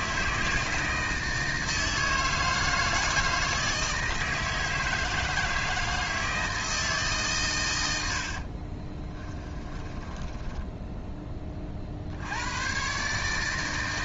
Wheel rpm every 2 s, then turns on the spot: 160, 160, 160, 160, 30, 10, 120.
8-12